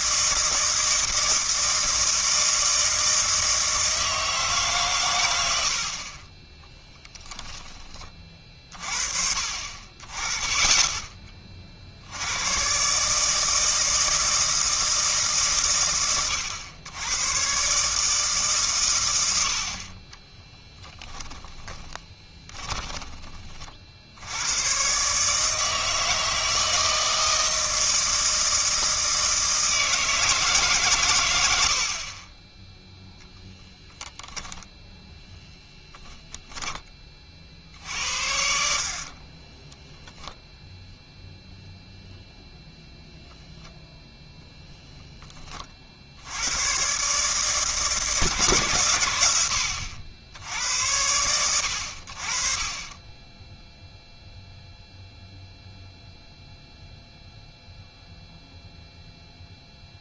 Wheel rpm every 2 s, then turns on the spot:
160, 160, 140, 10, 40, 20, 130, 160, 100, 120, 10, 20, 110, 160, 160, 140, 0, 0, 20, 60, 0, 0, 0, 110, 130, 80, 30, 0, 0, 0.
6-8 20-24 36-40